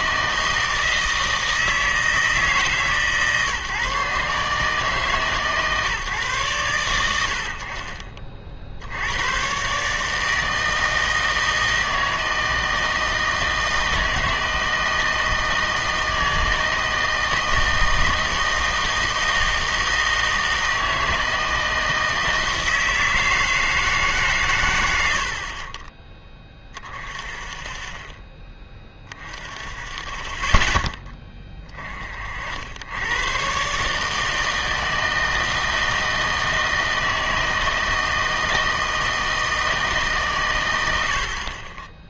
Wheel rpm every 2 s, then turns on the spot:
160, 150, 150, 100, 70, 160, 160, 160, 160, 160, 160, 160, 100, 40, 20, 10, 80, 160, 160, 160, 90.
none